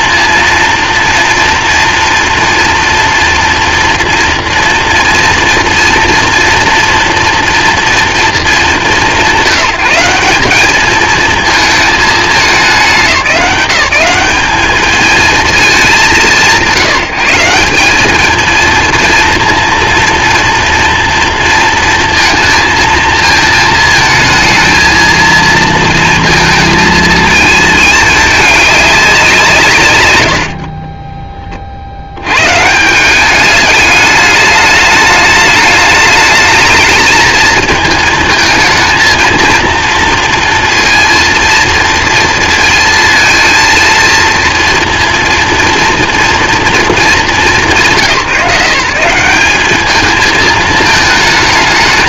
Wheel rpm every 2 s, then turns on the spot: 230, 230, 230, 230, 170, 220, 170, 210, 170, 230, 230, 220, 220, 220, 190, 20, 180, 210, 220, 230, 230, 230, 230, 220, 180, 220.
30-32